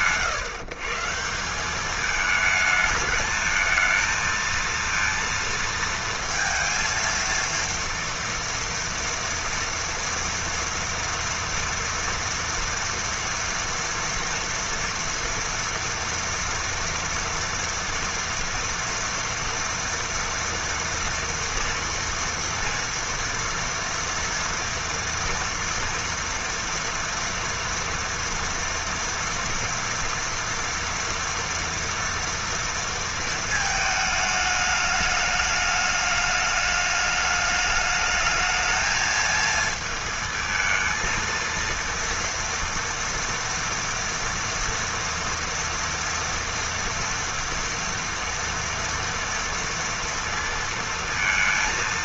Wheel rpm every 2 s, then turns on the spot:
160, 220, 230, 230, 230, 230, 230, 230, 230, 230, 230, 230, 230, 230, 230, 240, 230, 210, 210, 220, 230, 230, 230, 230, 230, 230.
none